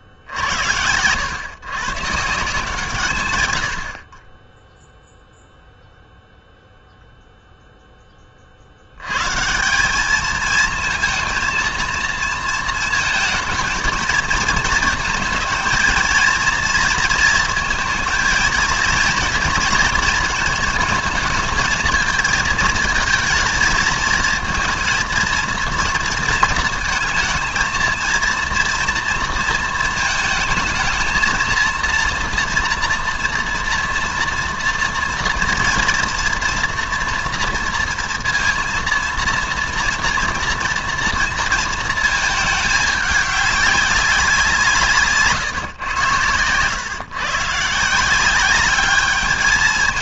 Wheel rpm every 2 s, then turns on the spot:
90, 160, 10, 0, 80, 230, 230, 220, 230, 230, 230, 220, 230, 230, 230, 220, 230, 240, 240, 230, 230, 210, 160, 110, 200.
none